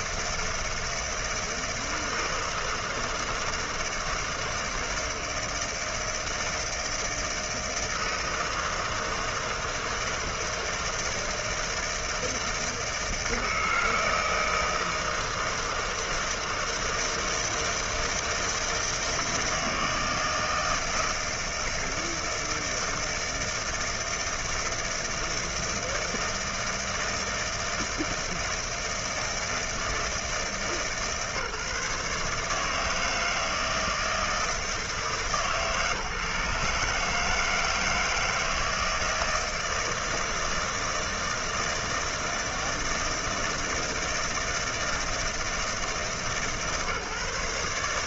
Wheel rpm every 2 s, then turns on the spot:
160, 160, 160, 160, 160, 160, 160, 160, 160, 160, 160, 160, 160, 160, 160, 150, 160, 160, 150, 160, 160, 160, 160, 150.
none